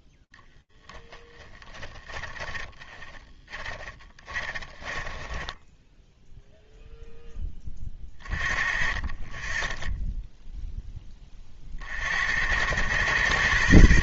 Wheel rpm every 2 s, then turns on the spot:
10, 20, 20, 10, 20, 20, 80.
0-6